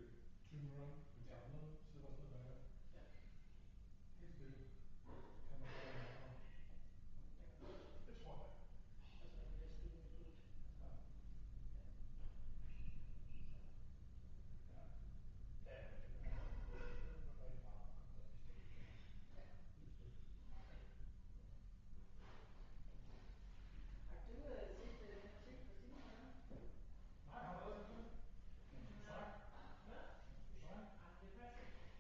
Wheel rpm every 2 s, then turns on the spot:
0, 0, 0, 0, 0, 0, 0, 0, 0, 0, 0, 0, 0, 0, 0, 0.
none